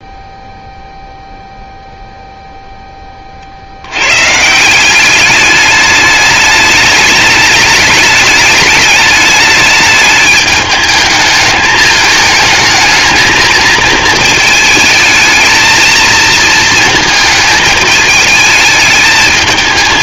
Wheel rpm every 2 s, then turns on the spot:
0, 0, 170, 210, 210, 210, 220, 220, 220, 220.
none